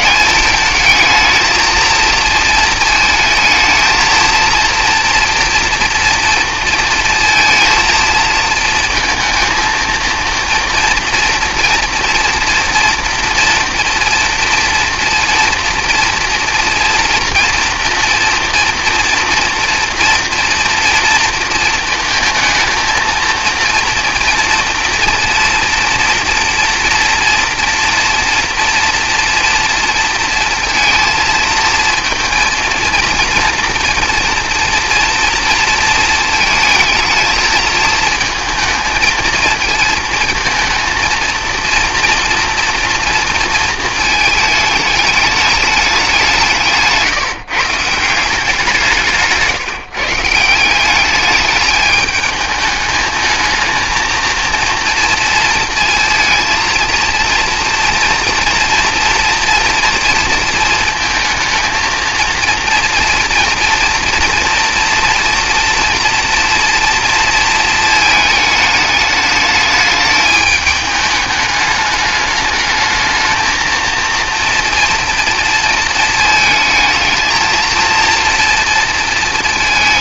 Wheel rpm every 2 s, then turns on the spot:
210, 220, 230, 230, 220, 230, 230, 230, 230, 230, 230, 230, 230, 230, 240, 230, 230, 230, 230, 220, 230, 230, 210, 160, 170, 190, 220, 230, 230, 230, 230, 230, 240, 230, 210, 210, 220, 230, 220, 230.
none